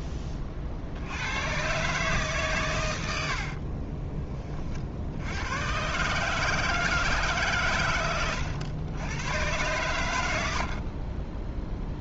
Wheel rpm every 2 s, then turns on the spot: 60, 100, 50, 150, 100, 50.
10-12